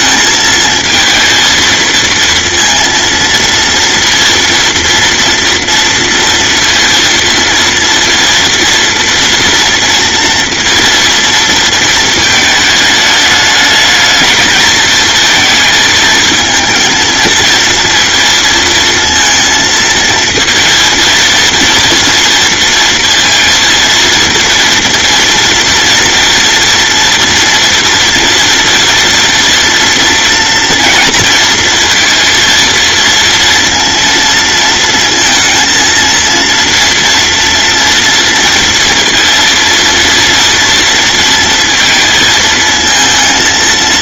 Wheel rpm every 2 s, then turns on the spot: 220, 230, 230, 230, 230, 230, 220, 220, 220, 230, 230, 230, 230, 230, 230, 240, 230, 230, 230, 230, 230, 220.
none